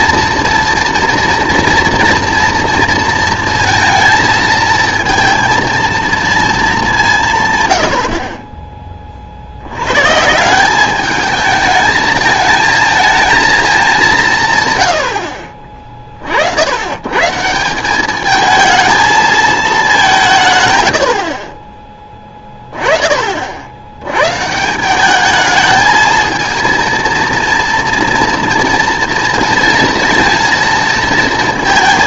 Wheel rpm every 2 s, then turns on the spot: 230, 230, 220, 220, 30, 170, 220, 140, 80, 220, 140, 10, 150, 230, 230, 230.
none